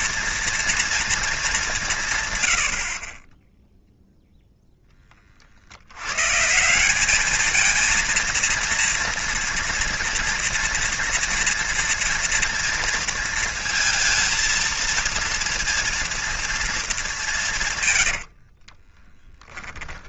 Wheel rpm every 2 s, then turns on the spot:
230, 70, 10, 180, 230, 230, 230, 230, 230, 50.
18-20